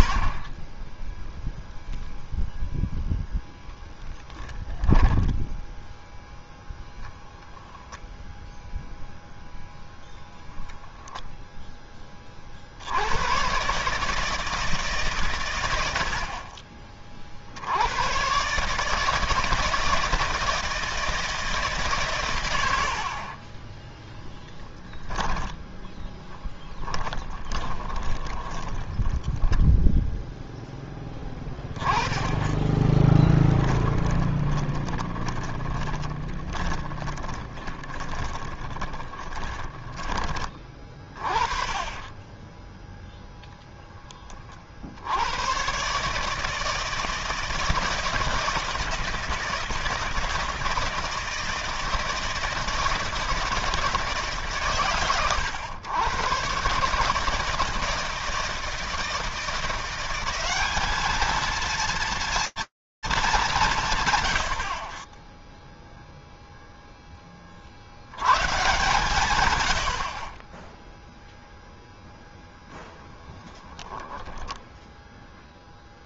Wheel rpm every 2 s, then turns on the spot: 40, 0, 10, 0, 0, 0, 40, 160, 60, 120, 160, 120, 10, 10, 10, 0, 10, 20, 20, 20, 20, 20, 20, 150, 160, 160, 160, 150, 120, 160, 190, 220, 60, 0, 130, 30, 0, 0.
4-6 28-30 32-40